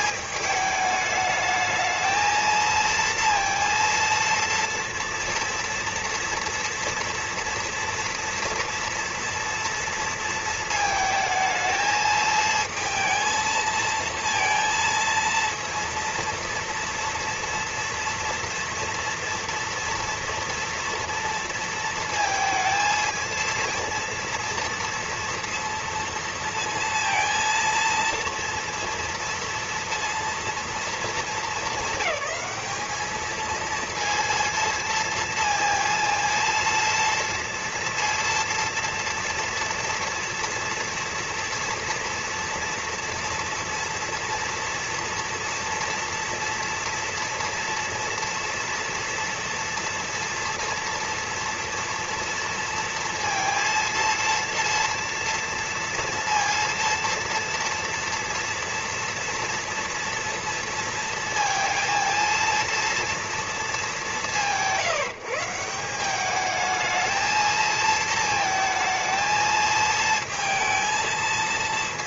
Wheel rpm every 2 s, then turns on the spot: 210, 220, 230, 230, 230, 220, 220, 230, 230, 230, 230, 230, 230, 230, 230, 220, 200, 230, 230, 230, 240, 230, 230, 230, 230, 230, 230, 230, 230, 230, 230, 230, 170, 210, 230, 230.
none